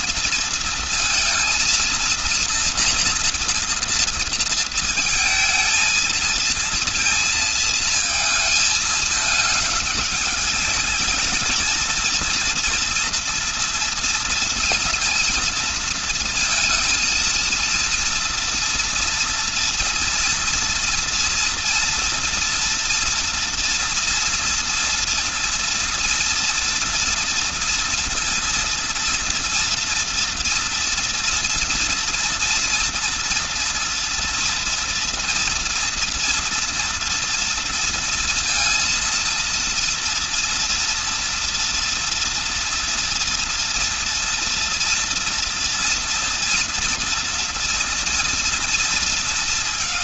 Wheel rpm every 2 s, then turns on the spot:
230, 230, 230, 230, 220, 210, 230, 230, 230, 230, 230, 230, 230, 230, 230, 230, 230, 240, 240, 230, 230, 230, 230, 230, 230.
none